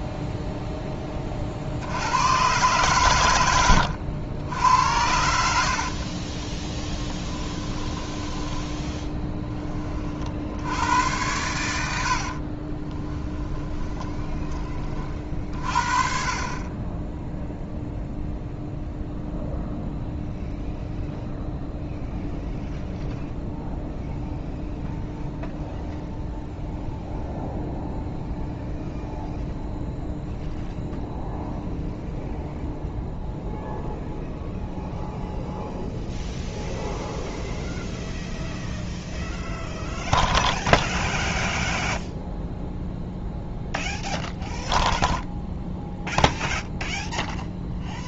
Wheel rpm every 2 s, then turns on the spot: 10, 120, 80, 10, 10, 80, 30, 40, 20, 0, 0, 0, 0, 0, 0, 0, 0, 0, 0, 0, 0, 0, 0, 0.
12-14